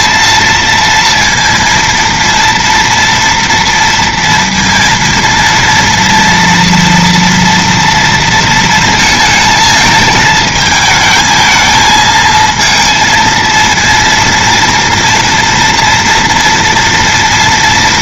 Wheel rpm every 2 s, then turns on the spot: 230, 230, 230, 230, 220, 220, 230, 230, 230.
none